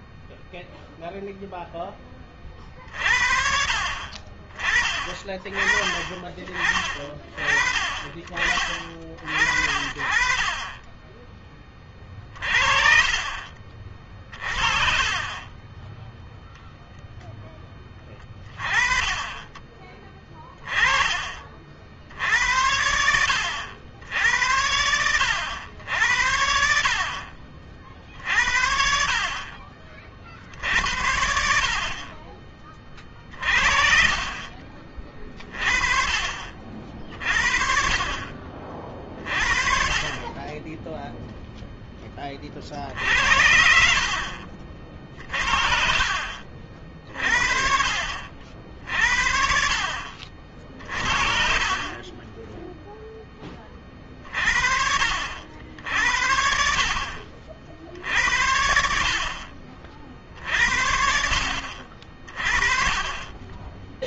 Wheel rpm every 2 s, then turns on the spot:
0, 40, 40, 30, 40, 30, 30, 40, 0, 20, 30, 70, 80, 50, 60, 60, 30, 30, 40, 30, 20, 50, 40, 40, 50, 50, 10, 40, 60, 70, 60, 30.
none